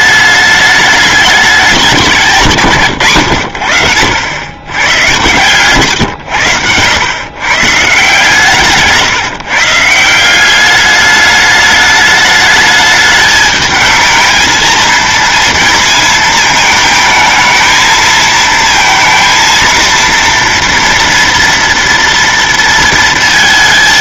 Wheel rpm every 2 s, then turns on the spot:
210, 140, 110, 100, 150, 200, 210, 230, 220, 230, 230, 230.
none